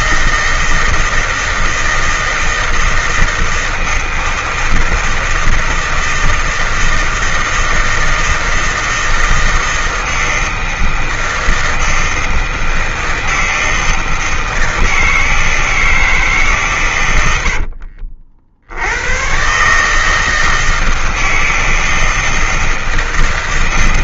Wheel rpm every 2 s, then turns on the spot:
160, 160, 160, 160, 160, 160, 160, 160, 140, 80, 160, 160.
none